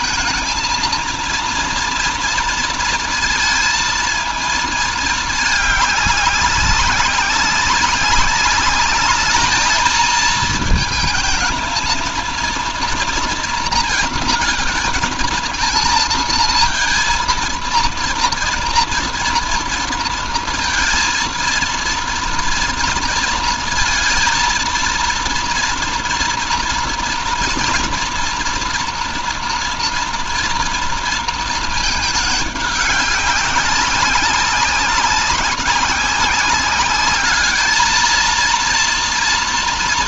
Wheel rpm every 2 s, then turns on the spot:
220, 230, 220, 190, 210, 220, 230, 230, 230, 230, 230, 230, 230, 230, 230, 230, 200, 200, 200, 230.
none